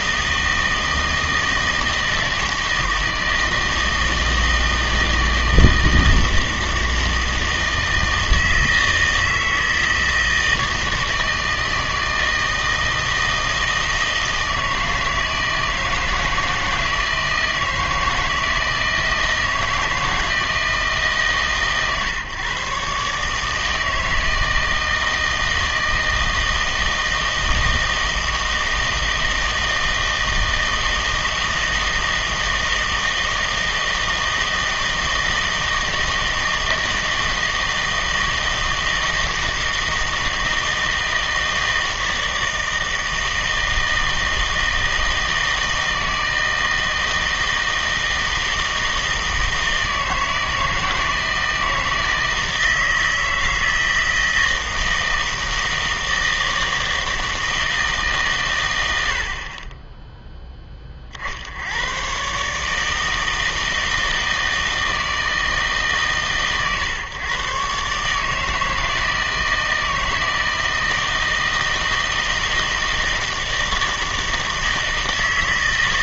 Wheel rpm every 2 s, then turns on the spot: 160, 160, 160, 160, 160, 160, 160, 160, 160, 160, 150, 130, 160, 160, 160, 160, 160, 160, 160, 160, 160, 160, 160, 160, 160, 160, 160, 160, 160, 100, 20, 150, 160, 140, 160, 160, 160, 160.
none